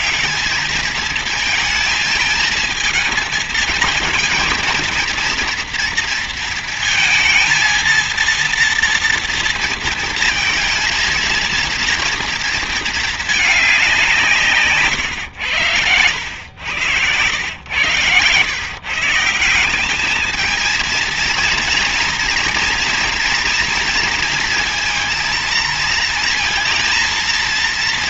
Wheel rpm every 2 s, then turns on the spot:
220, 220, 230, 230, 230, 230, 220, 130, 110, 160, 230, 230, 230, 230.
none